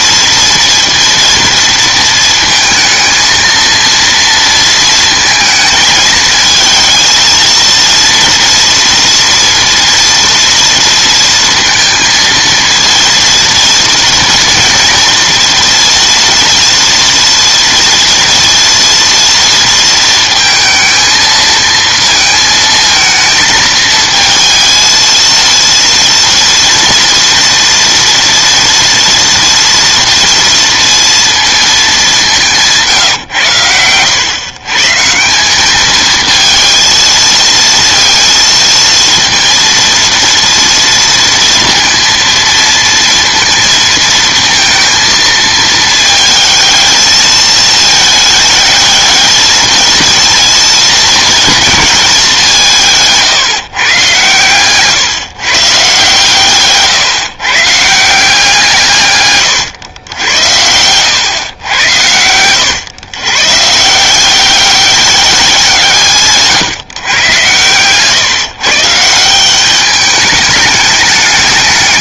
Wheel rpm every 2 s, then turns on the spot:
230, 220, 230, 230, 230, 230, 230, 230, 230, 230, 220, 230, 220, 240, 230, 230, 160, 150, 230, 230, 230, 230, 230, 220, 220, 230, 170, 140, 150, 150, 100, 110, 200, 140, 150, 210.
60-62